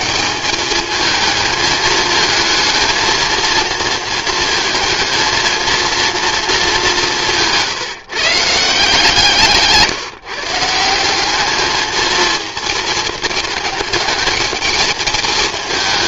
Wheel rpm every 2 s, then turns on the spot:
190, 220, 220, 220, 170, 160, 230, 220.
none